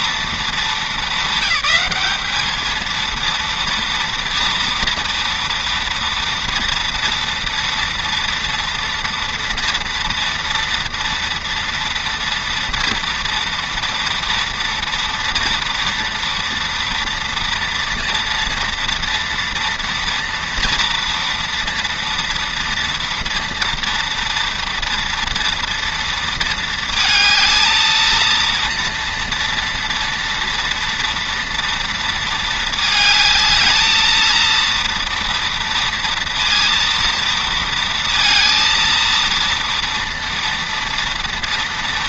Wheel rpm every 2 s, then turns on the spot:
220, 220, 230, 240, 230, 230, 230, 230, 230, 230, 230, 230, 230, 220, 230, 230, 220, 230, 230, 230, 230.
none